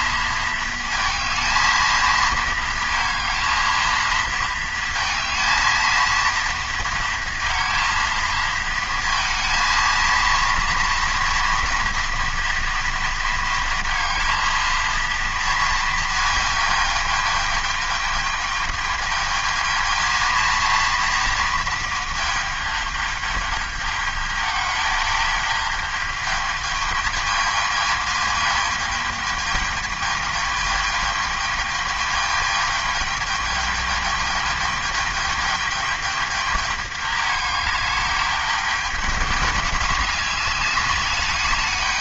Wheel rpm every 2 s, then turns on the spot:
220, 230, 230, 230, 220, 230, 230, 230, 210, 220, 230, 210, 210, 220, 210, 210, 210, 210, 210, 210, 210.
none